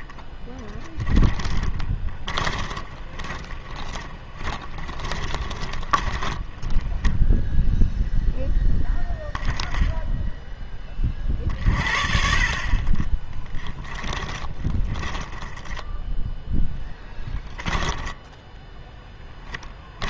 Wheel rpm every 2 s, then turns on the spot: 20, 20, 20, 10, 0, 10, 40, 20, 10, 10.
0-8 14-20